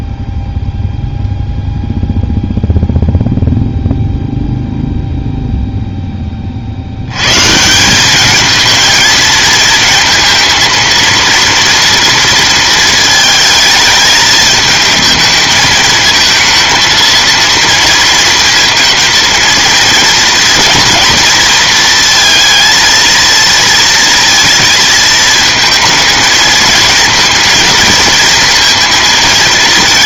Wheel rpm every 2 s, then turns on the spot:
0, 0, 0, 50, 220, 230, 230, 210, 230, 230, 240, 230, 230, 220, 230.
none